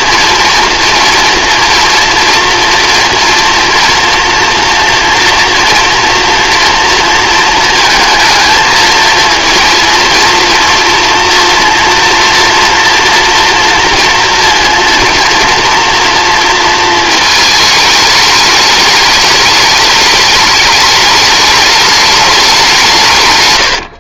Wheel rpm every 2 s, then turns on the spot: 230, 230, 230, 230, 220, 240, 240, 230, 230, 210, 210, 190.
none